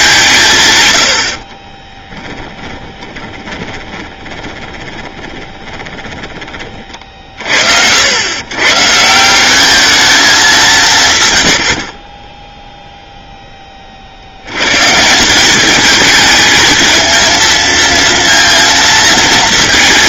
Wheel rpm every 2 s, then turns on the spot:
130, 10, 20, 40, 130, 170, 0, 120, 220, 230.
2-6